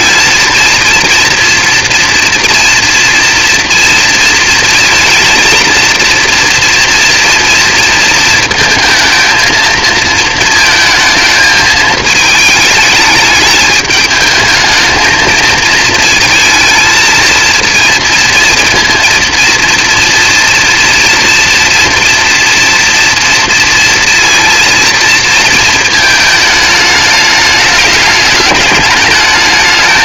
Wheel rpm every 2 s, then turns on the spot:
230, 230, 230, 230, 220, 220, 210, 220, 230, 230, 240, 230, 230, 210, 210.
none